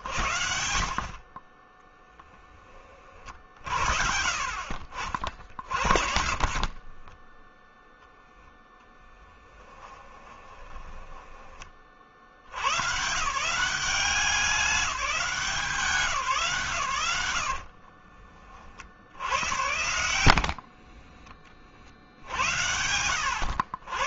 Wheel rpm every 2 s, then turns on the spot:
60, 30, 60, 40, 10, 20, 120, 180, 130, 60, 40, 70.
6-8 10-12 20-22